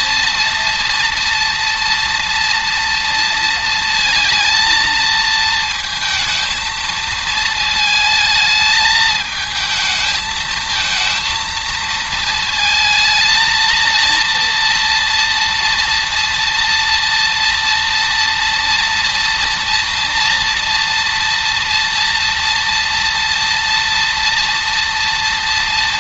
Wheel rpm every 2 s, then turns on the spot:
230, 230, 230, 220, 220, 220, 230, 230, 230, 230, 230, 230, 230.
none